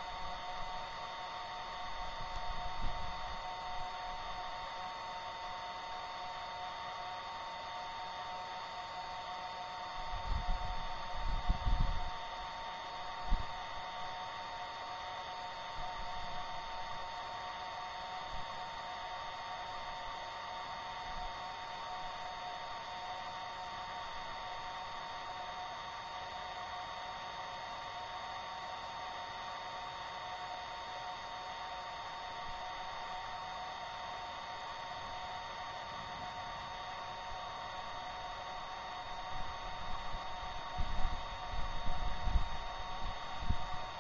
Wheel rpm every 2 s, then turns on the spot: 0, 0, 0, 0, 0, 0, 0, 0, 0, 0, 0, 0, 0, 0, 0, 0, 0, 0, 0, 0, 0, 0.
none